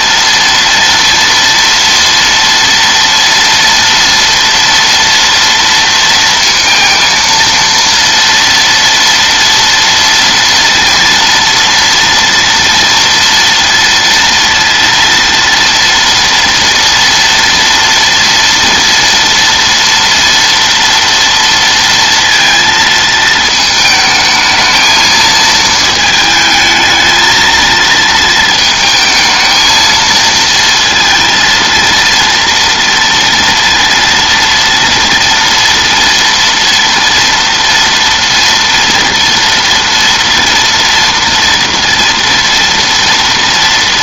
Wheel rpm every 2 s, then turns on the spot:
230, 230, 230, 230, 230, 230, 230, 230, 230, 240, 230, 230, 220, 220, 220, 230, 230, 230, 230, 230, 240, 230.
none